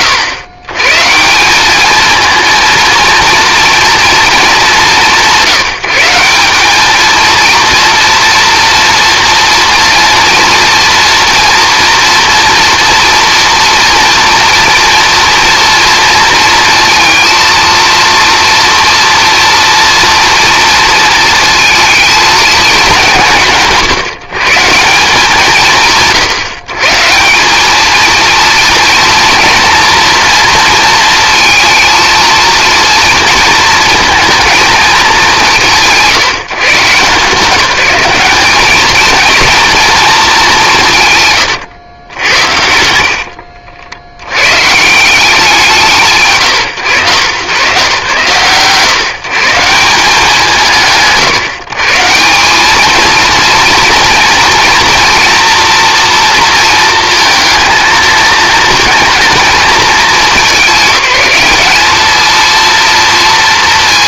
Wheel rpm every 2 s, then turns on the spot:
140, 230, 170, 220, 240, 230, 230, 230, 230, 240, 230, 180, 140, 150, 230, 230, 230, 220, 160, 220, 180, 80, 130, 120, 130, 130, 220, 230, 230, 230, 200, 230.
42-44